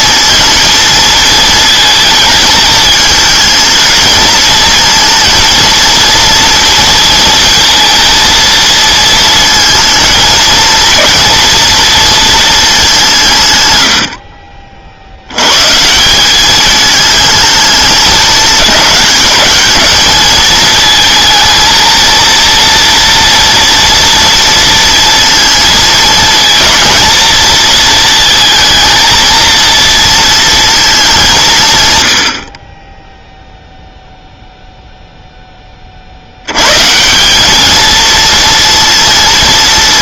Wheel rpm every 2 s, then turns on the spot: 230, 220, 220, 230, 230, 220, 220, 50, 200, 200, 220, 230, 230, 220, 230, 230, 50, 0, 110, 230.
none